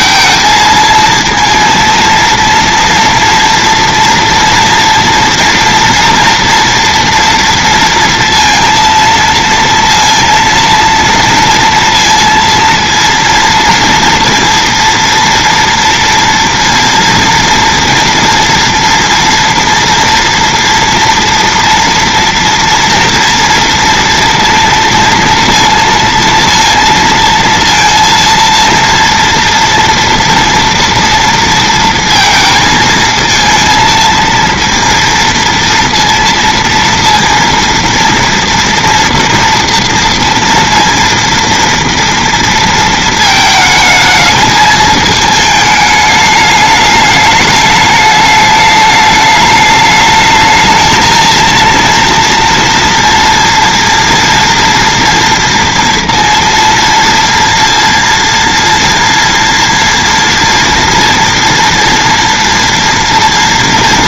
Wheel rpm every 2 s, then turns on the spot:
230, 230, 230, 230, 230, 230, 230, 230, 230, 230, 230, 240, 230, 230, 230, 230, 220, 230, 230, 230, 230, 230, 220, 210, 210, 220, 230, 230, 230, 230, 230, 230.
none